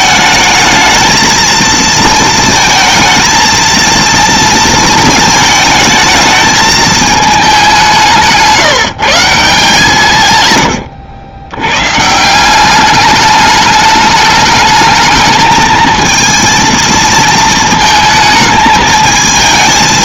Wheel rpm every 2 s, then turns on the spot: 220, 220, 230, 220, 160, 110, 180, 220, 220, 220.
none